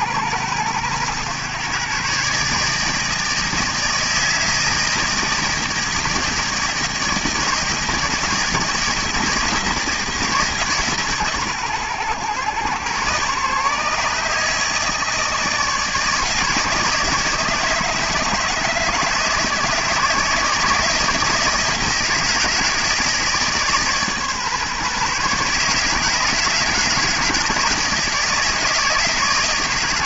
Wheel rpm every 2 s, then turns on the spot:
110, 150, 160, 160, 160, 150, 120, 150, 150, 150, 160, 160, 140, 150, 160.
none